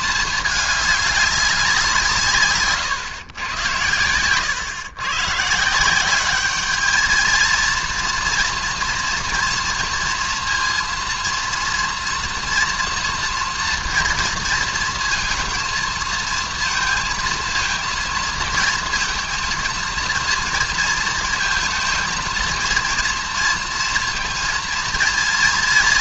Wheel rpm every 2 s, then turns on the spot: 200, 140, 120, 220, 240, 230, 230, 230, 230, 230, 230, 230, 230.
none